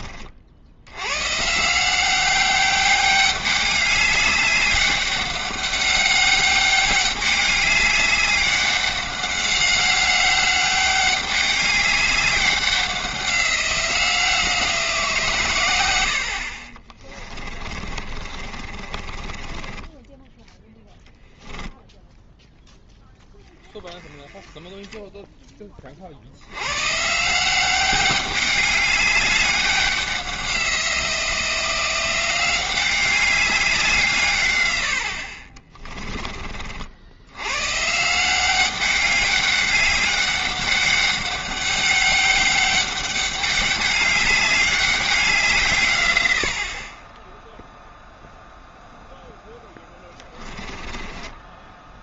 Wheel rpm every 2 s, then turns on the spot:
70, 200, 200, 200, 200, 190, 190, 170, 40, 30, 0, 0, 10, 110, 200, 180, 190, 100, 50, 190, 200, 200, 200, 50, 0, 10.
18-20 50-52